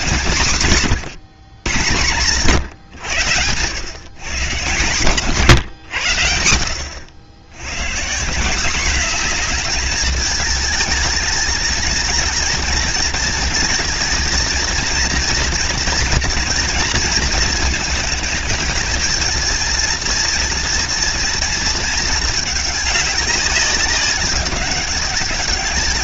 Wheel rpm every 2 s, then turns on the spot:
130, 120, 130, 90, 220, 230, 230, 240, 220, 230, 230, 200, 200.
none